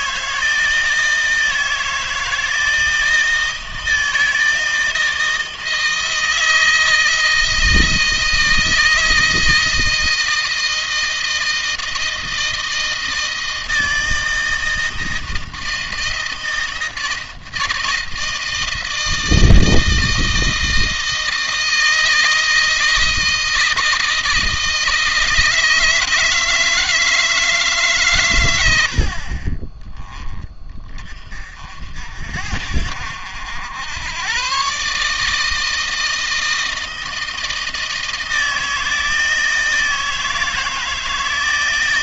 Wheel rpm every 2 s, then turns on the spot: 160, 160, 160, 160, 160, 160, 160, 160, 160, 160, 160, 160, 160, 160, 100, 20, 60, 130, 160, 160, 160.
none